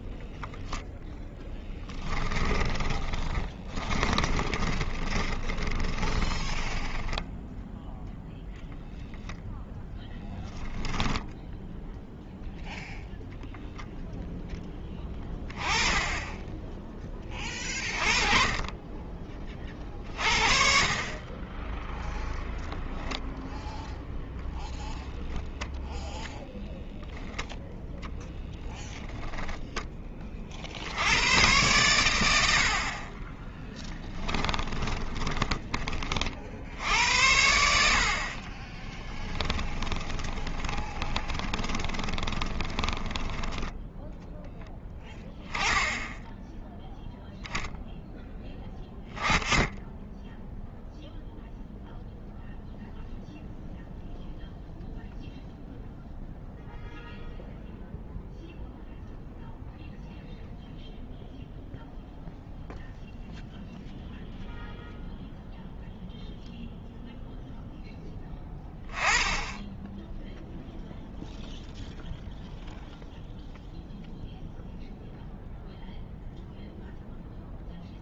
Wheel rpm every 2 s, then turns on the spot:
10, 20, 20, 10, 10, 10, 0, 20, 20, 20, 40, 0, 10, 0, 0, 90, 40, 20, 80, 10, 20, 20, 10, 0, 10, 0, 0, 0, 0, 0, 0, 0, 0, 0, 10, 0, 0, 0, 0.
2-8 34-36 38-44